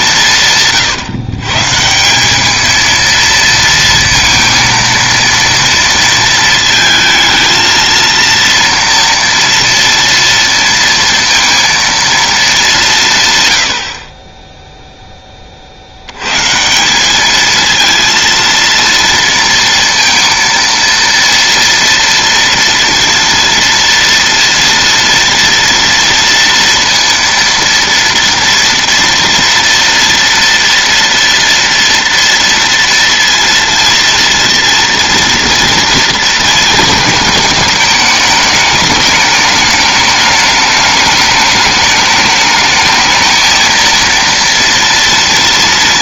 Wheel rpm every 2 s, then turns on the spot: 140, 220, 230, 220, 230, 230, 190, 0, 160, 230, 230, 230, 230, 230, 230, 230, 230, 230, 230, 210, 210, 210, 230.
none